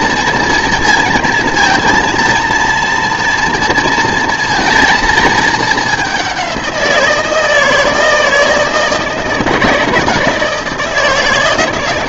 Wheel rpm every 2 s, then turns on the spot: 230, 230, 230, 180, 160, 170.
none